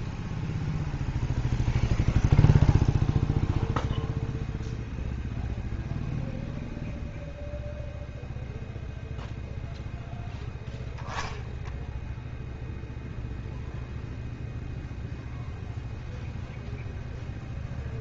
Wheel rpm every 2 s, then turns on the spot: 0, 0, 0, 0, 0, 0, 0, 0, 0.
none